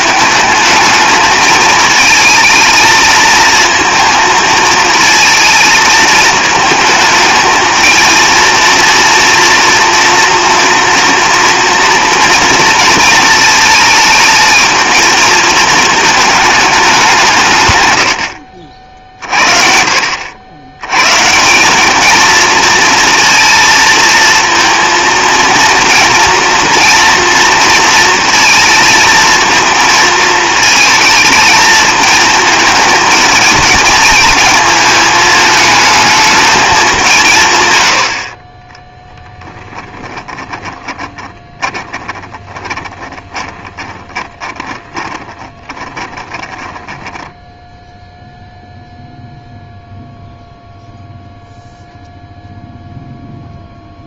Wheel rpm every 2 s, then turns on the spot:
220, 220, 220, 220, 230, 240, 230, 220, 210, 60, 90, 230, 230, 240, 230, 220, 220, 220, 210, 30, 20, 30, 20, 10, 0, 0, 0.
40-48